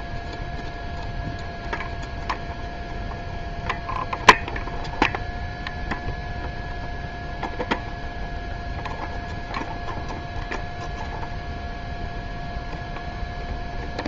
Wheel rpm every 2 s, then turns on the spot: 0, 0, 0, 0, 0, 0, 0.
none